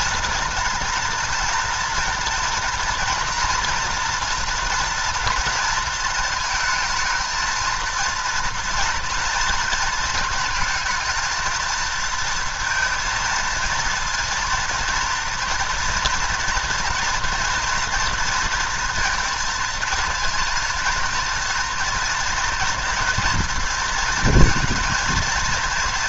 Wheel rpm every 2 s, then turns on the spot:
230, 230, 230, 220, 230, 230, 230, 230, 230, 230, 220, 230, 230.
none